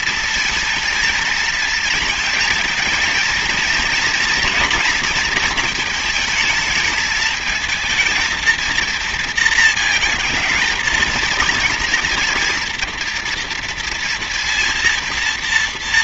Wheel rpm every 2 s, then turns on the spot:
230, 220, 230, 220, 230, 230, 230, 230.
none